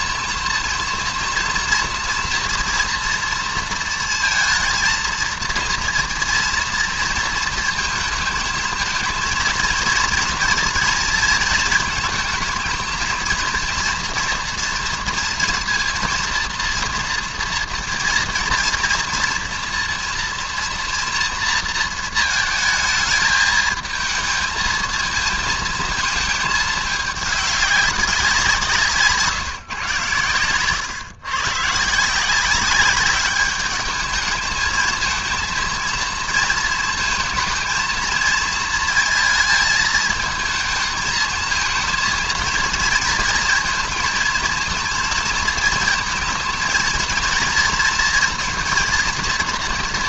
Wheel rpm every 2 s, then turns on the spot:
240, 240, 230, 230, 220, 240, 230, 230, 230, 230, 230, 220, 220, 220, 180, 120, 190, 220, 230, 230, 220, 230, 220, 230, 230.
none